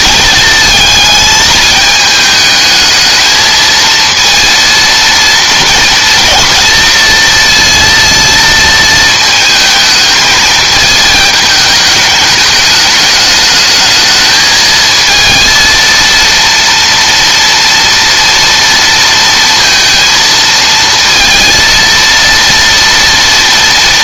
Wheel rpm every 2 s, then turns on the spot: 220, 220, 230, 230, 220, 220, 220, 220, 230, 230, 220, 230.
none